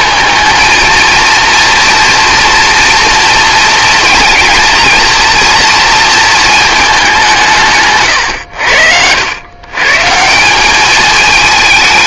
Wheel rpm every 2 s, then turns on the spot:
230, 230, 230, 210, 80, 200.
none